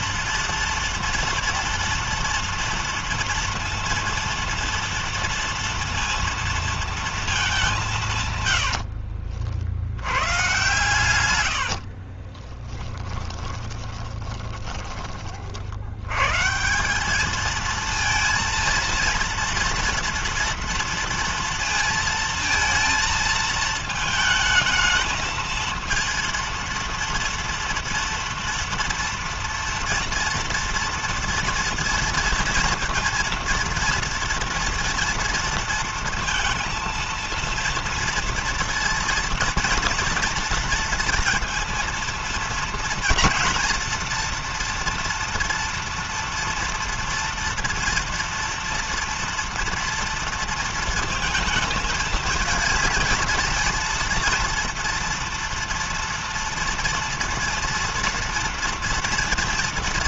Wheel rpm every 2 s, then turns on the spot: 230, 230, 230, 230, 70, 110, 20, 30, 180, 230, 230, 230, 220, 230, 230, 230, 230, 230, 230, 230, 230, 230, 230, 230, 230, 230, 230, 230, 230, 230.
8-14